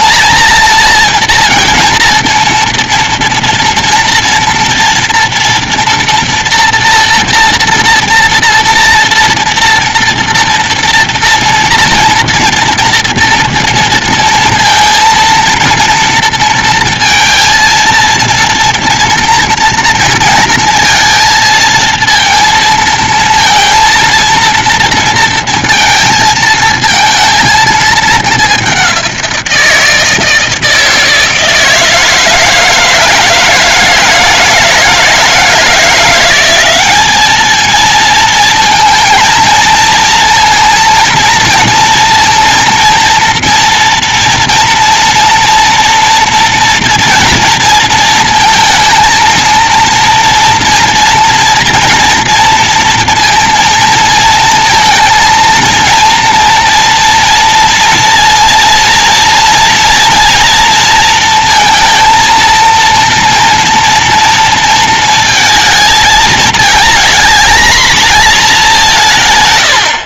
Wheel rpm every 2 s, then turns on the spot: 230, 230, 230, 230, 240, 230, 230, 230, 230, 230, 230, 230, 230, 230, 210, 160, 160, 160, 180, 220, 230, 230, 230, 240, 230, 230, 230, 230, 230, 230, 230, 230, 230, 220, 220.
none